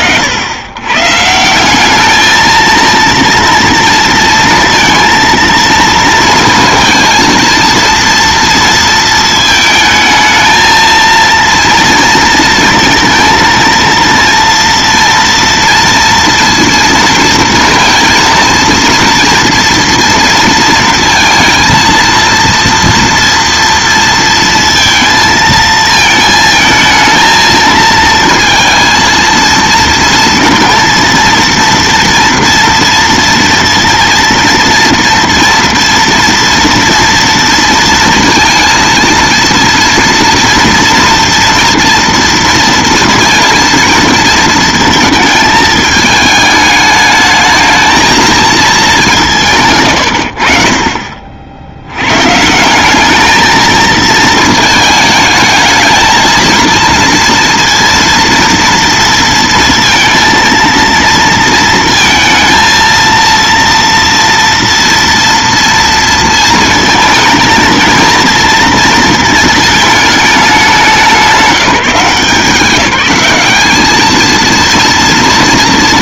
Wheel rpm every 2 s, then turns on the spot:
110, 230, 230, 230, 230, 220, 230, 230, 230, 230, 230, 230, 230, 220, 230, 230, 230, 230, 230, 230, 240, 230, 230, 220, 220, 50, 170, 220, 220, 230, 230, 230, 230, 230, 230, 200, 180, 230.
none